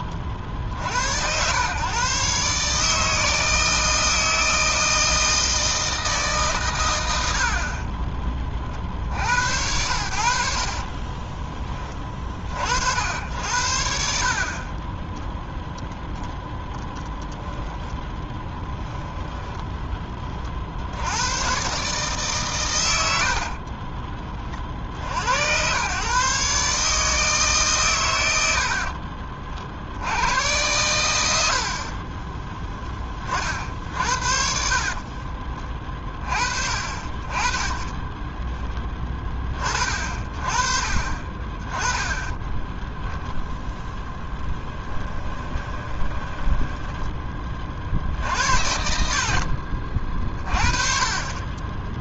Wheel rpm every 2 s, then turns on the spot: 60, 150, 160, 120, 50, 40, 80, 20, 10, 20, 70, 110, 50, 150, 50, 110, 10, 40, 40, 10, 30, 0, 10, 10, 80, 30.
10-12 14-20 28-30 34-36 44-46